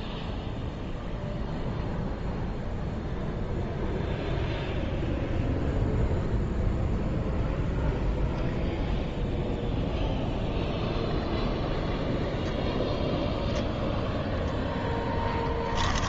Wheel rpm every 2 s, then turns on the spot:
0, 0, 0, 0, 0, 0, 0, 0.
none